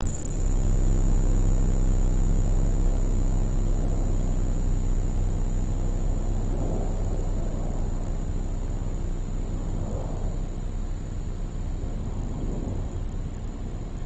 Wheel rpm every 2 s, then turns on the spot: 0, 0, 0, 0, 0, 0, 0.
none